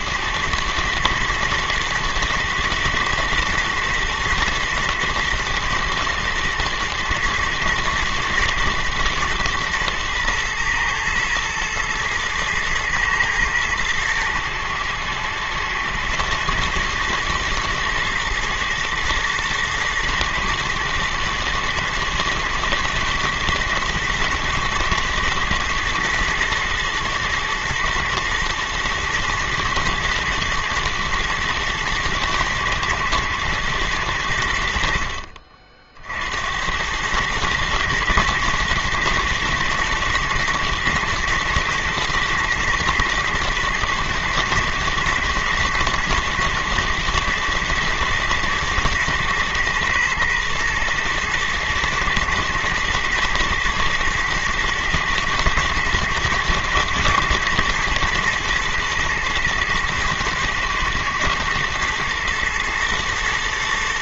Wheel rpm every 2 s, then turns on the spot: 110, 110, 110, 110, 110, 110, 110, 110, 110, 120, 120, 120, 110, 110, 120, 110, 110, 80, 80, 110, 120, 110, 120, 110, 120, 120, 110, 120, 120, 120, 110, 120.
none